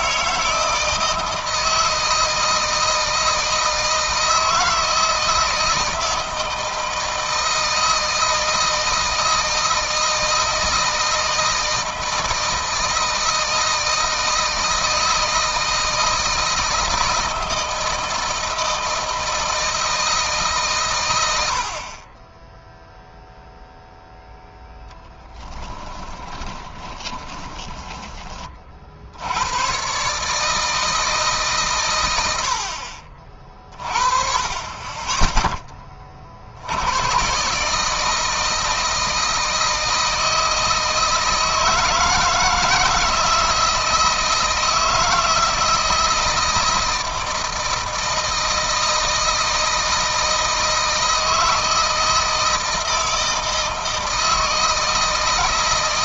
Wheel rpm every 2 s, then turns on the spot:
160, 160, 170, 160, 160, 160, 160, 160, 160, 160, 140, 10, 0, 20, 40, 160, 70, 20, 70, 160, 160, 160, 160, 160, 160, 160, 160, 160.
26-28